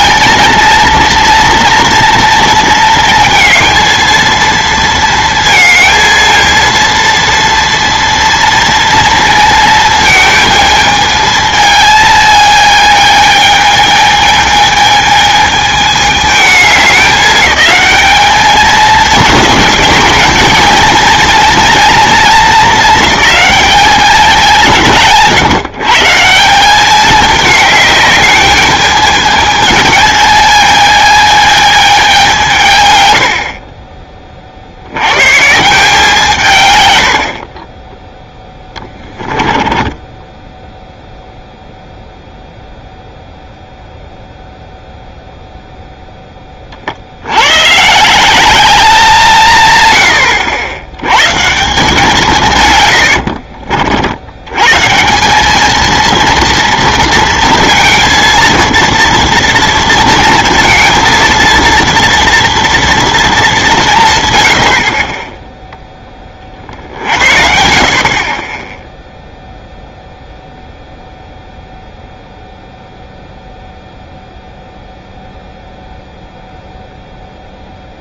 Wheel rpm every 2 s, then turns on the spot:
230, 230, 230, 230, 230, 220, 220, 220, 210, 220, 230, 220, 180, 190, 210, 220, 150, 60, 130, 10, 10, 0, 0, 30, 190, 90, 140, 120, 230, 230, 220, 230, 80, 40, 20, 0, 0, 0, 0.
38-42